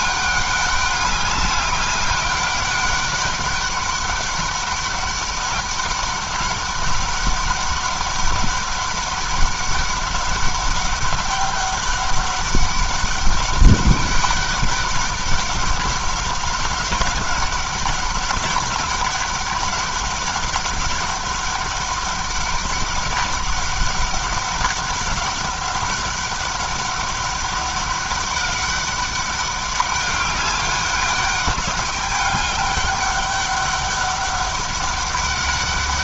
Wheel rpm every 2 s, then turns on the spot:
200, 200, 200, 200, 200, 200, 200, 200, 190, 200, 200, 200, 190, 200, 190, 200, 200, 200.
none